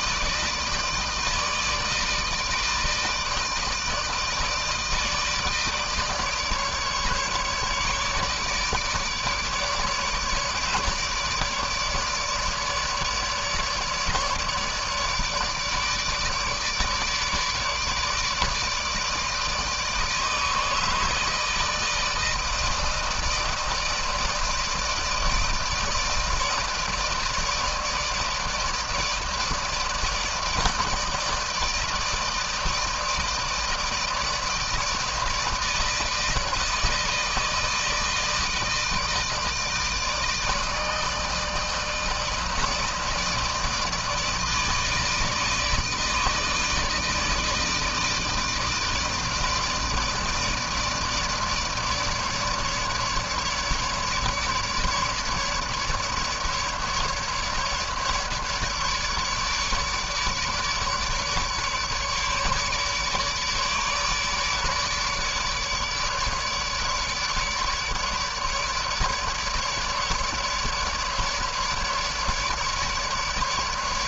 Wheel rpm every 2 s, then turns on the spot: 160, 160, 160, 150, 150, 150, 150, 150, 150, 150, 150, 160, 160, 160, 160, 160, 160, 160, 160, 160, 150, 160, 160, 160, 160, 160, 150, 150, 150, 150, 150, 150, 150, 150, 150, 150, 150.
none